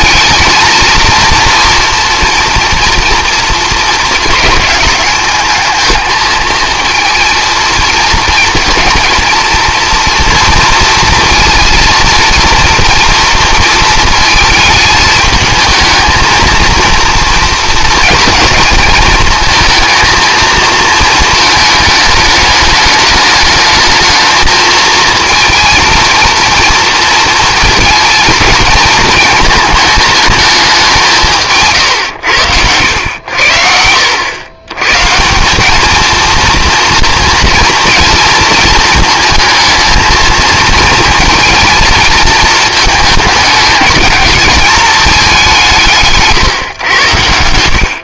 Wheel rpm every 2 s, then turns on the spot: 230, 230, 220, 220, 230, 240, 230, 220, 230, 220, 220, 210, 220, 230, 220, 200, 90, 120, 230, 230, 220, 220, 210, 120.
none